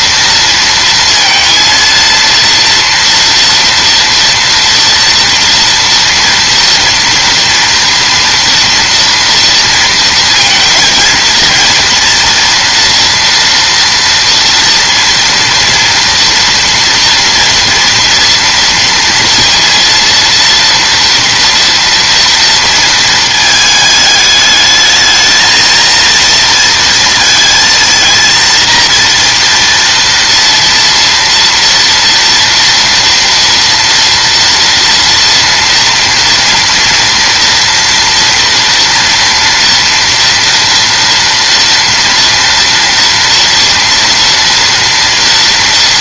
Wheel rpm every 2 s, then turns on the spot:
230, 230, 230, 230, 230, 230, 230, 230, 230, 230, 230, 230, 220, 230, 230, 230, 230, 230, 230, 230, 240, 230, 230.
none